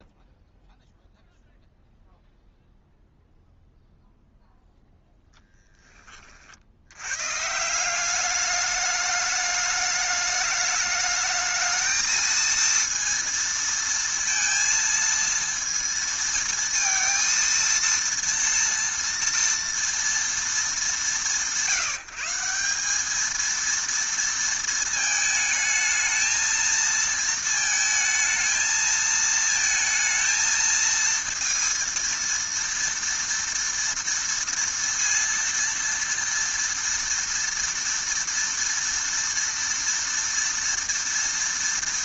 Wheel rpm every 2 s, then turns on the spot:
0, 0, 0, 70, 210, 210, 230, 230, 230, 230, 200, 180, 230, 230, 220, 230, 230, 230, 230, 230, 230.
none